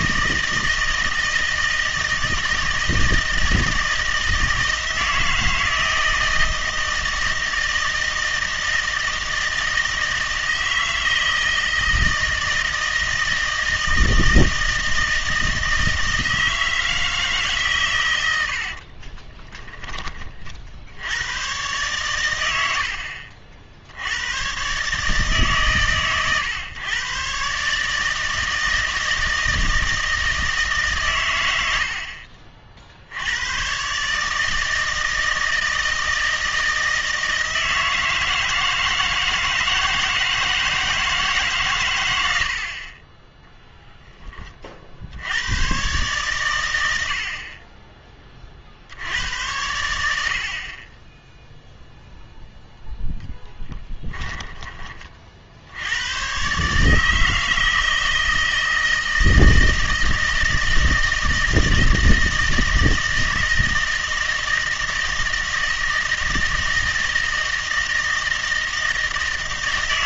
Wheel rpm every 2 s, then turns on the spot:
160, 160, 170, 160, 160, 160, 160, 160, 160, 60, 60, 80, 130, 120, 160, 150, 50, 160, 160, 160, 160, 40, 40, 100, 60, 40, 0, 20, 140, 160, 160, 160, 160, 160, 160.
18-20